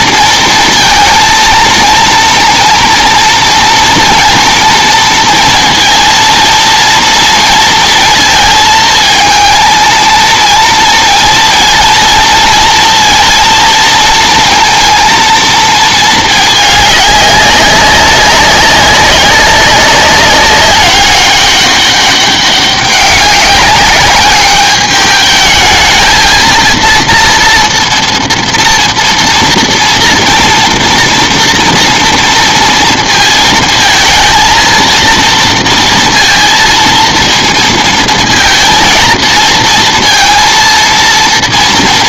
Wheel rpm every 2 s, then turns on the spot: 230, 230, 230, 230, 230, 230, 230, 230, 210, 190, 190, 200, 200, 230, 230, 230, 230, 230, 230, 230, 230.
none